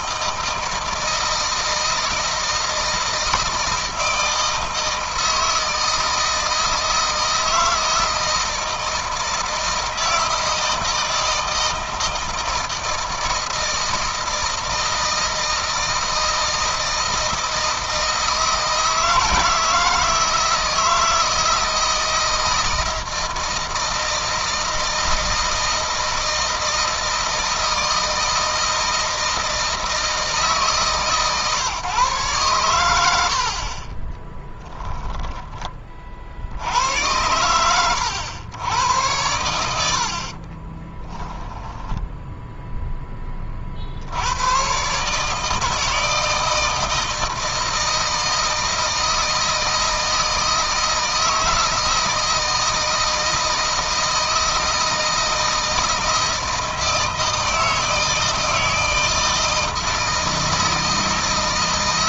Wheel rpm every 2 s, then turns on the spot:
160, 170, 160, 160, 160, 160, 160, 160, 160, 160, 160, 160, 160, 160, 160, 150, 110, 10, 80, 100, 30, 10, 120, 160, 160, 160, 160, 160, 160, 160, 160.
34-36 40-42